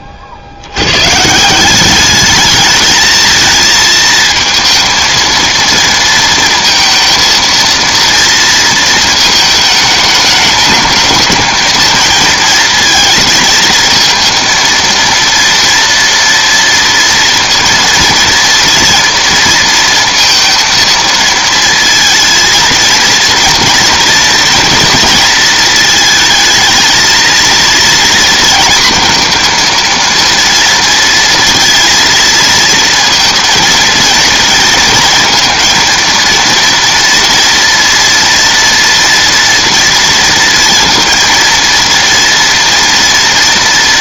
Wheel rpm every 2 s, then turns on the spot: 120, 220, 230, 230, 220, 210, 220, 230, 230, 230, 230, 230, 230, 230, 230, 230, 230, 230, 230, 230, 230, 230.
none